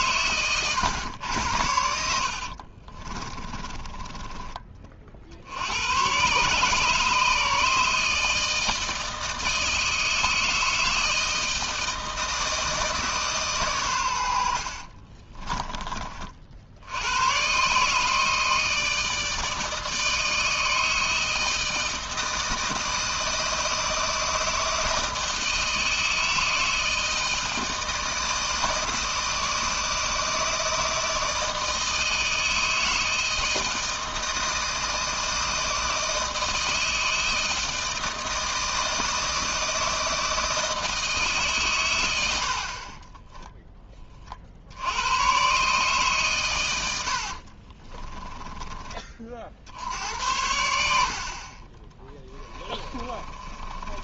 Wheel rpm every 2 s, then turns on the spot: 110, 50, 30, 140, 160, 160, 160, 60, 70, 160, 160, 160, 160, 160, 160, 160, 160, 160, 160, 160, 160, 50, 60, 110, 20, 80, 40.
2-4 14-16 42-44 52-54